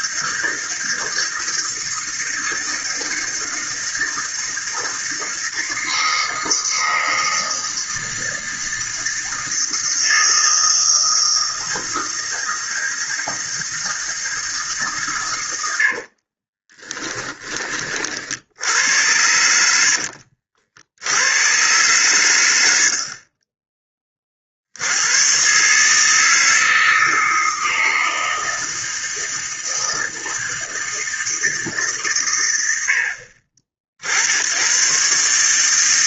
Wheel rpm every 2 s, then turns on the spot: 160, 160, 160, 160, 160, 160, 160, 150, 30, 80, 70, 70, 70, 160, 160, 160, 90, 110.
16-18 22-24